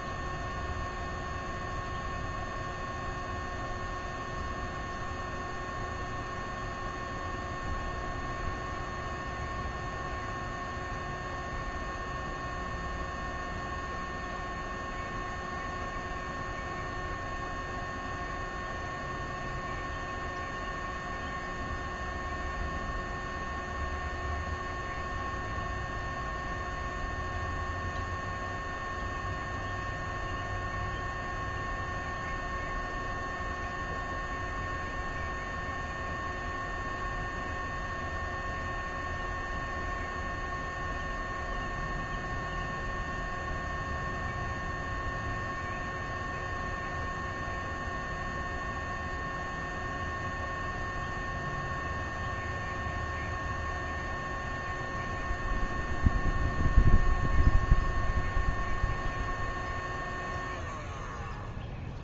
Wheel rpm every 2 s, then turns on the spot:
0, 0, 0, 0, 0, 0, 0, 0, 0, 0, 0, 0, 0, 0, 0, 0, 0, 0, 0, 0, 0, 0, 0, 0, 0, 0, 0, 0, 0, 0, 0.
none